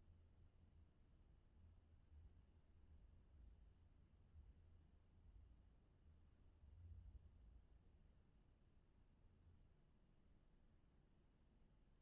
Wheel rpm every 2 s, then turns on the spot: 0, 0, 0, 0, 0, 0.
none